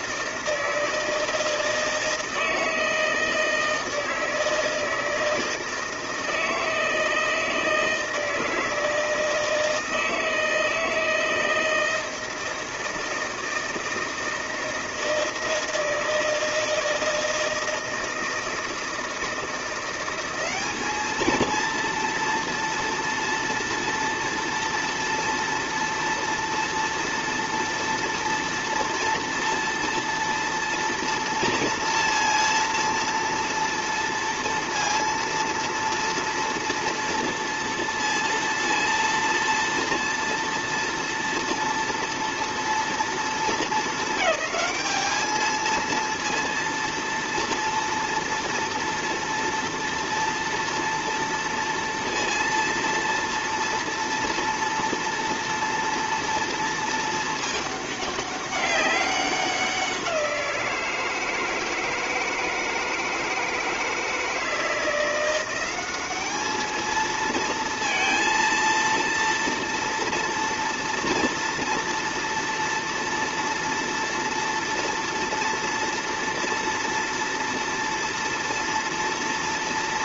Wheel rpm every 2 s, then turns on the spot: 160, 160, 160, 160, 160, 160, 160, 160, 160, 160, 190, 230, 230, 230, 230, 230, 230, 230, 230, 230, 230, 230, 210, 230, 230, 230, 230, 230, 230, 200, 170, 160, 160, 210, 230, 230, 240, 230, 230, 230.
none